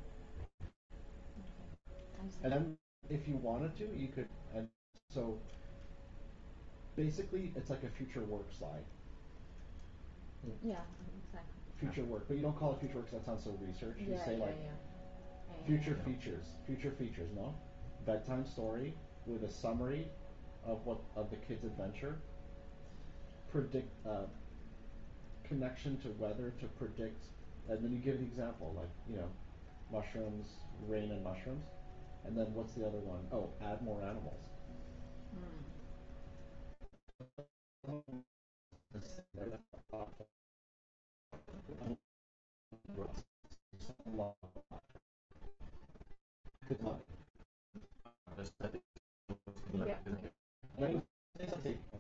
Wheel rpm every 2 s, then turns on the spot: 0, 0, 0, 0, 0, 0, 0, 0, 0, 0, 0, 0, 0, 0, 0, 0, 0, 0, 0, 0, 0, 0, 0, 0, 0, 0.
none